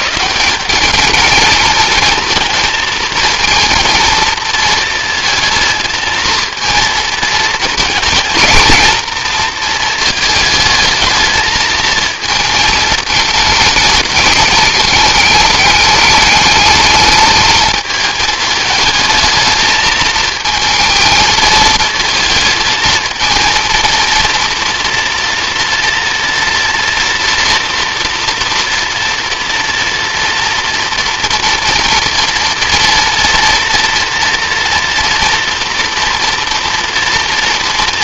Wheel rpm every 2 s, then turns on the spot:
200, 230, 230, 230, 230, 220, 220, 210, 220, 210, 220, 220, 230, 240, 230, 230, 230, 230, 240.
none